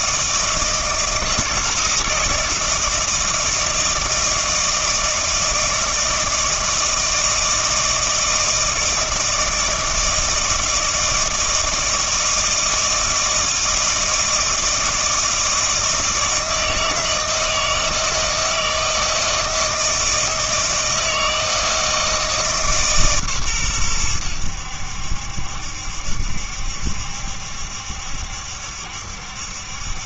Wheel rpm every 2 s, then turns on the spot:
160, 160, 160, 160, 160, 160, 160, 160, 160, 160, 160, 150, 80, 70, 70.
none